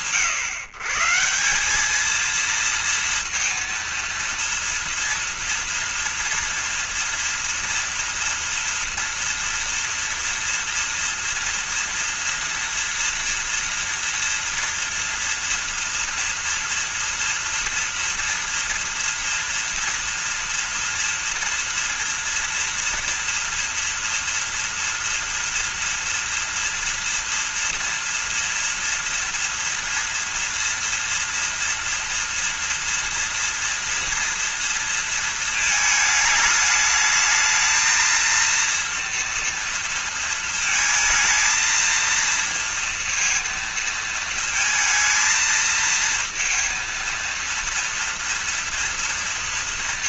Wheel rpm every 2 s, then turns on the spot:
140, 230, 230, 230, 240, 230, 230, 230, 230, 230, 230, 230, 230, 230, 240, 230, 230, 230, 220, 230, 220, 230, 230, 230, 230.
none